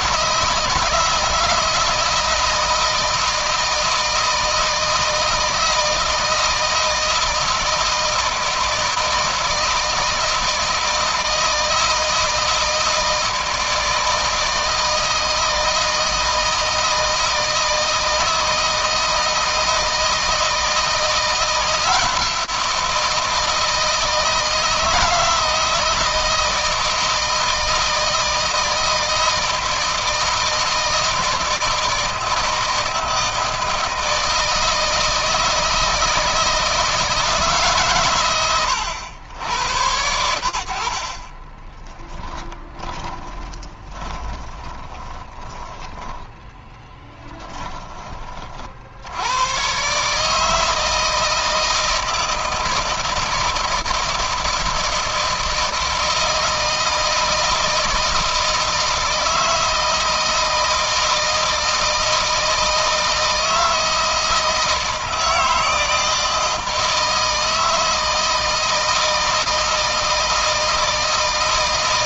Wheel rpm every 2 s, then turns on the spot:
160, 160, 160, 160, 160, 160, 160, 160, 160, 160, 170, 170, 160, 160, 160, 160, 160, 160, 160, 90, 50, 20, 20, 10, 80, 160, 160, 160, 160, 160, 160, 160, 160, 160, 160, 160.
42-48